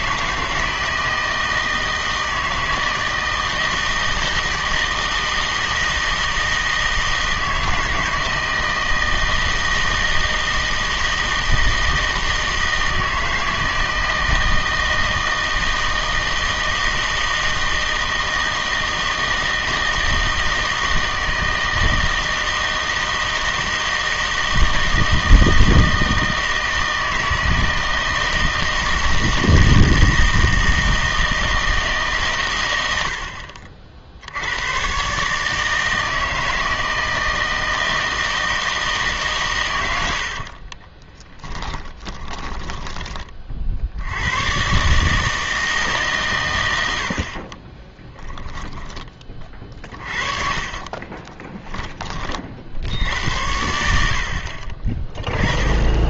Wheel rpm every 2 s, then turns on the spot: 160, 160, 160, 160, 160, 160, 160, 160, 160, 160, 160, 160, 160, 160, 160, 160, 100, 110, 160, 160, 60, 20, 130, 90, 10, 30, 60, 40.
40-44 48-52